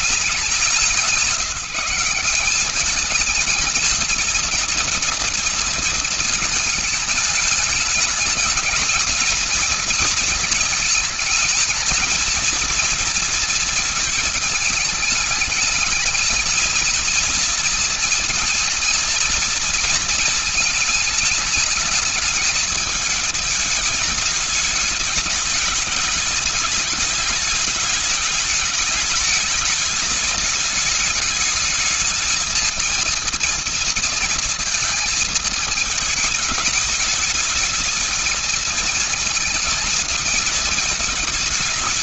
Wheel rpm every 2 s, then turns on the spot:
180, 190, 230, 220, 210, 230, 230, 210, 220, 230, 220, 220, 210, 210, 220, 210, 220, 230, 210, 230, 220.
none